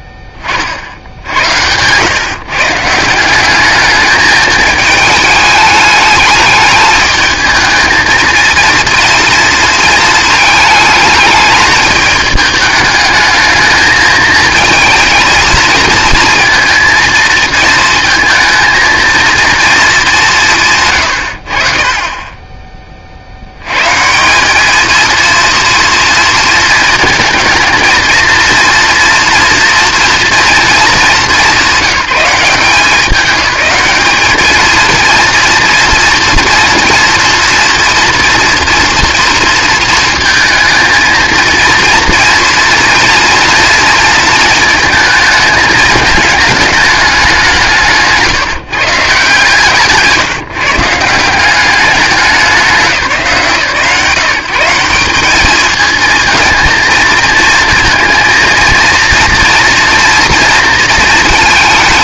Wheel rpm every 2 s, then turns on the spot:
30, 140, 220, 220, 230, 220, 210, 230, 230, 230, 160, 20, 210, 230, 230, 220, 190, 220, 230, 230, 230, 230, 220, 210, 160, 140, 210, 180, 220, 230, 230.
none